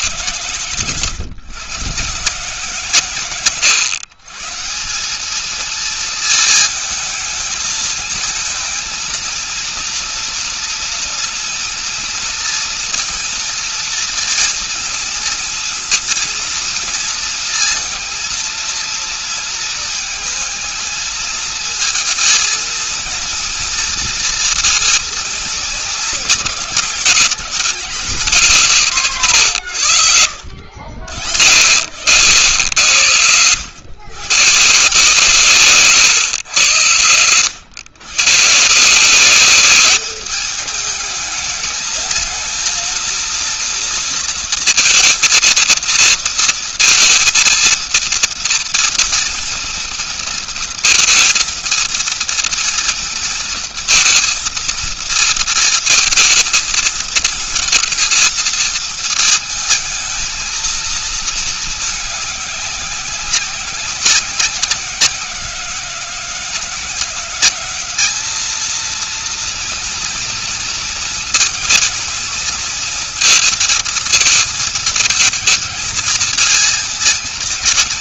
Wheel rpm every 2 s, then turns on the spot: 120, 130, 200, 220, 220, 230, 230, 230, 230, 230, 230, 230, 230, 210, 160, 70, 80, 140, 110, 170, 210, 230, 230, 230, 230, 230, 230, 230, 220, 220, 230, 190, 180, 180, 230, 230, 230, 220, 220.
none